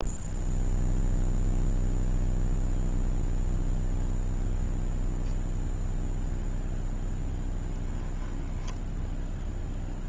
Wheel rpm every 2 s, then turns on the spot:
0, 0, 0, 0, 0.
none